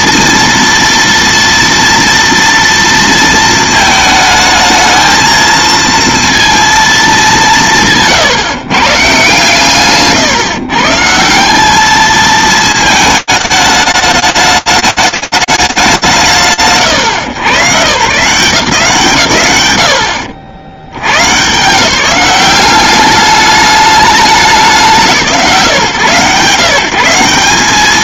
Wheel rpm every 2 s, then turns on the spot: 230, 230, 220, 230, 150, 140, 220, 170, 120, 80, 170, 210, 140, 190.
none